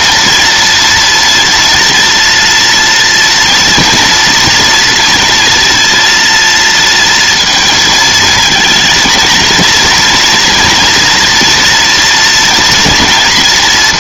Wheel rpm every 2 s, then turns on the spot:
230, 230, 240, 230, 230, 240, 230.
none